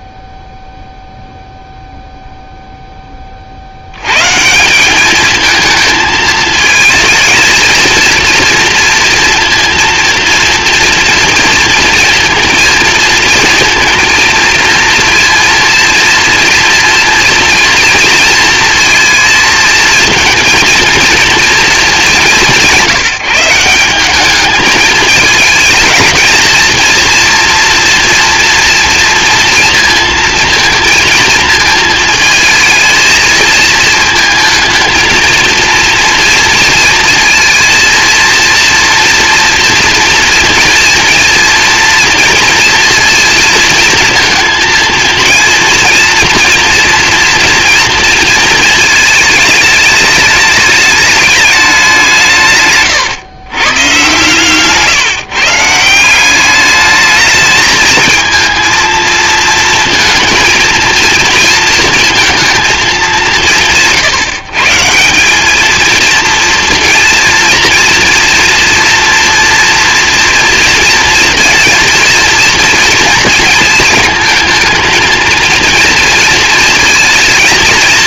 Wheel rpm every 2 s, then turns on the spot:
0, 80, 220, 230, 230, 230, 230, 230, 230, 220, 220, 180, 220, 230, 230, 220, 220, 230, 230, 230, 230, 230, 230, 230, 210, 200, 120, 160, 220, 230, 230, 160, 220, 230, 230, 230, 220, 230, 230.
none